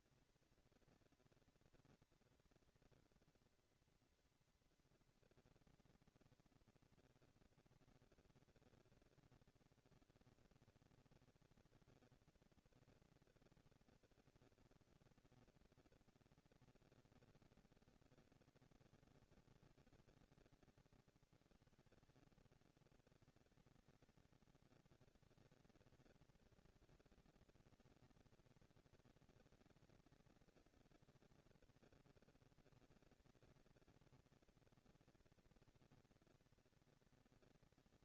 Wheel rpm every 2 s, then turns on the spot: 230, 230, 230, 230, 230, 220, 230, 230, 220, 210, 140, 140, 210, 230, 230, 230, 230, 230, 230.
none